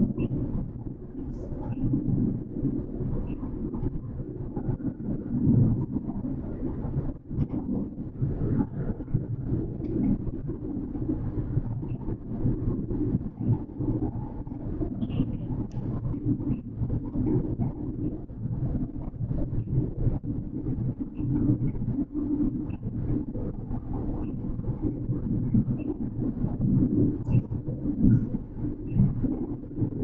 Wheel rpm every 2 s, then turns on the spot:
0, 0, 0, 0, 0, 0, 0, 0, 0, 0, 0, 0, 0, 0, 0.
none